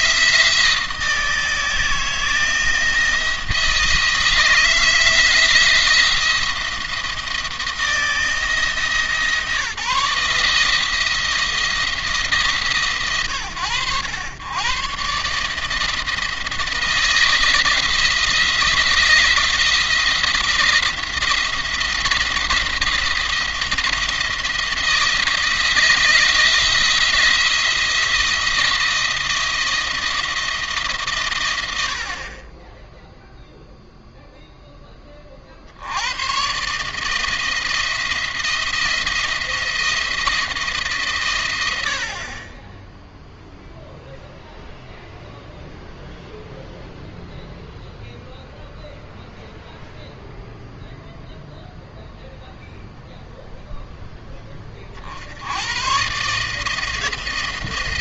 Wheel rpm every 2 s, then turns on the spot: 160, 170, 170, 170, 160, 160, 150, 120, 170, 170, 170, 170, 170, 170, 170, 160, 10, 10, 130, 170, 150, 20, 0, 0, 0, 0, 0, 30, 160.
none